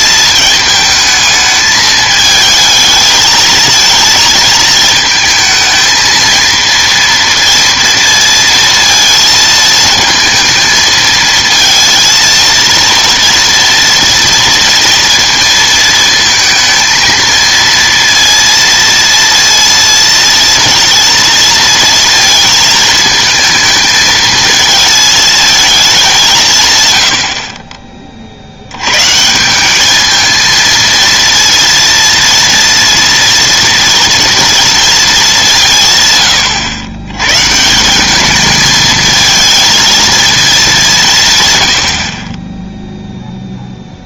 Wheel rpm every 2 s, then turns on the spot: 220, 220, 220, 230, 230, 220, 230, 230, 230, 230, 230, 220, 220, 140, 80, 230, 230, 230, 110, 220, 210, 10.
none